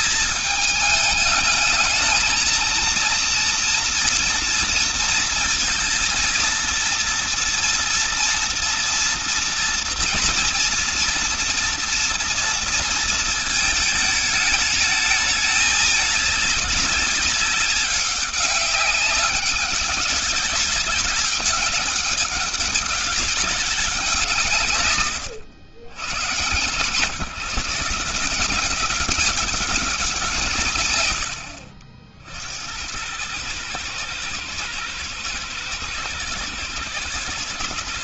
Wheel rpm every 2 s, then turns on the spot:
220, 230, 230, 230, 240, 230, 230, 220, 200, 200, 200, 200, 140, 130, 190, 140, 80, 110, 120.
none